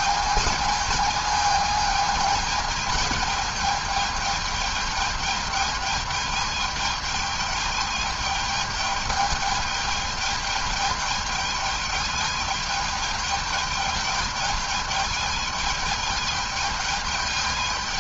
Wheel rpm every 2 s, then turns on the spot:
220, 220, 210, 210, 210, 210, 210, 210, 210.
none